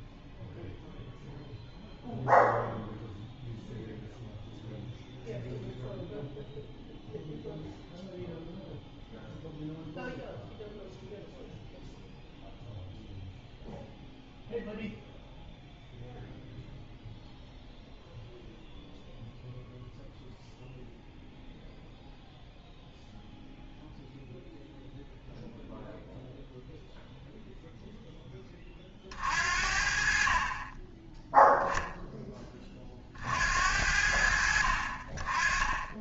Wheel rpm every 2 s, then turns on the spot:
0, 0, 0, 0, 0, 0, 0, 0, 0, 0, 0, 0, 0, 0, 30, 20, 20, 60.
none